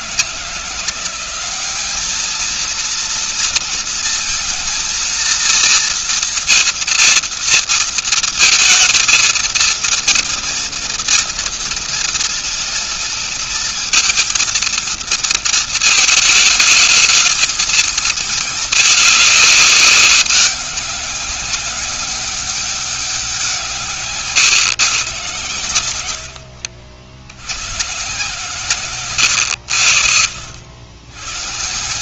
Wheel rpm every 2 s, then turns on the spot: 160, 220, 230, 230, 220, 230, 230, 230, 220, 220, 190, 200, 150, 80, 140, 80.
26-28